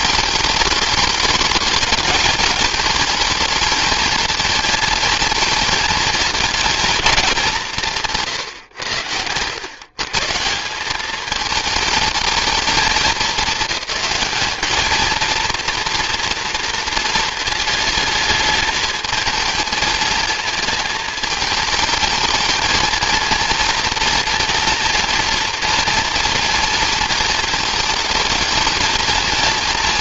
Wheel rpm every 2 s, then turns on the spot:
210, 220, 220, 220, 120, 190, 210, 220, 230, 220, 220, 220, 240, 230, 230.
none